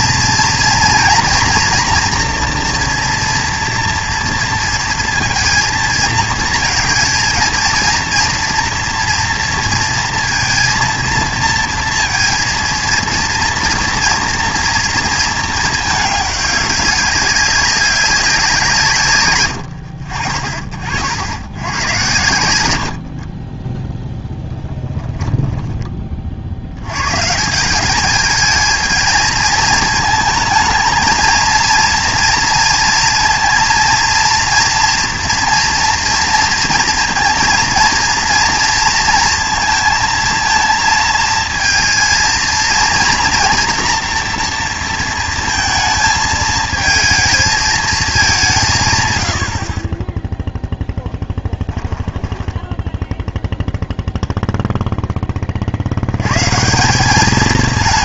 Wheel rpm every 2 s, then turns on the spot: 230, 230, 230, 230, 240, 230, 230, 230, 200, 160, 50, 80, 10, 90, 220, 220, 230, 230, 230, 230, 230, 230, 230, 220, 170, 0, 10, 0, 160.
24-26 52-54